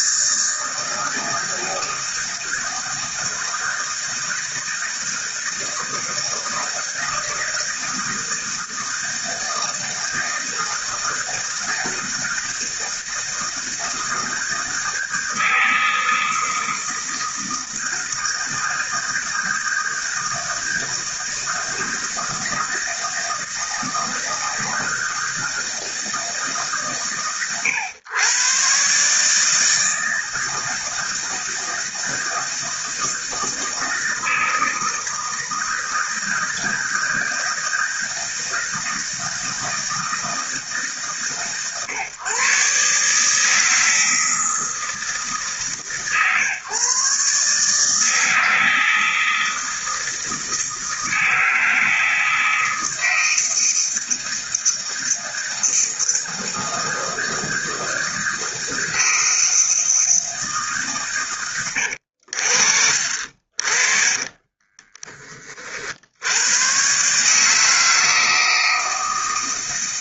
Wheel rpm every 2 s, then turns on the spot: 160, 160, 160, 160, 160, 160, 160, 160, 160, 160, 160, 160, 160, 140, 120, 160, 160, 160, 160, 160, 160, 140, 160, 130, 160, 160, 160, 160, 160, 160, 160, 80, 30, 100, 160.
64-66